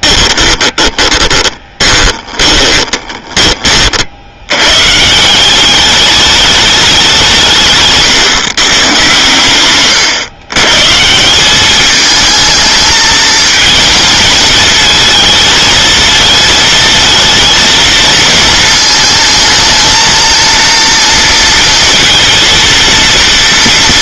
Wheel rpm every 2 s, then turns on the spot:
20, 20, 120, 200, 120, 130, 220, 220, 220, 220, 230, 230.
0-4